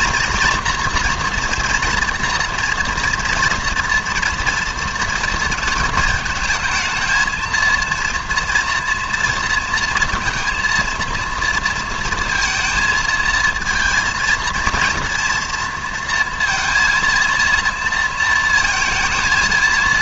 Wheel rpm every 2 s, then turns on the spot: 230, 230, 230, 220, 240, 230, 230, 230, 230, 230.
none